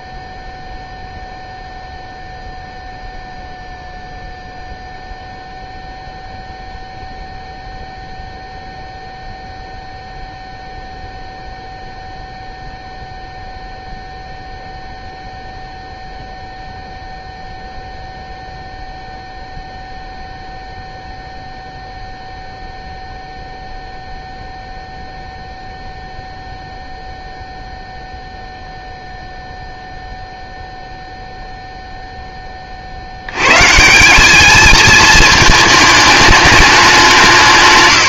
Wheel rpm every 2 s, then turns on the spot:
0, 0, 0, 0, 0, 0, 0, 0, 0, 0, 0, 0, 0, 0, 0, 0, 20, 220, 210.
none